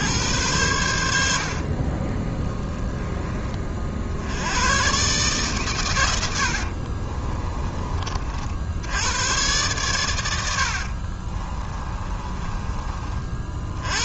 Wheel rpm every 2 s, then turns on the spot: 80, 10, 130, 50, 90, 50, 30.
6-8 10-12